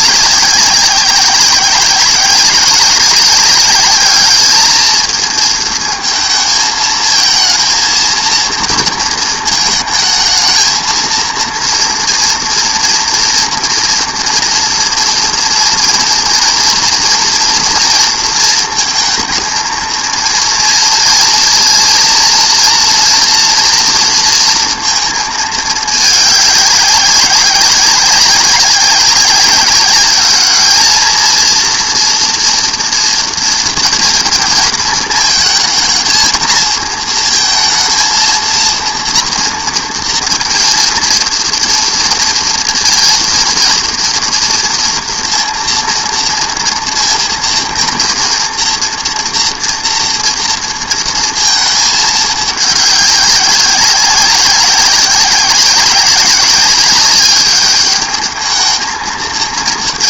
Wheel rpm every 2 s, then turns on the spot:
190, 190, 220, 220, 230, 220, 230, 230, 230, 220, 230, 230, 230, 200, 190, 210, 230, 220, 220, 230, 230, 230, 230, 230, 230, 230, 210, 190, 190, 220.
none